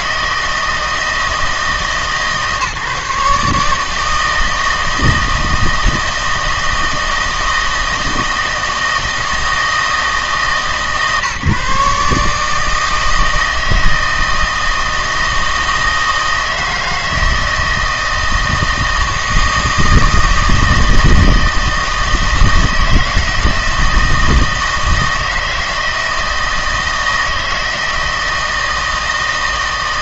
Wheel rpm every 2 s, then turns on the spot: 160, 150, 160, 160, 160, 140, 160, 160, 160, 160, 160, 160, 160, 160, 160.
none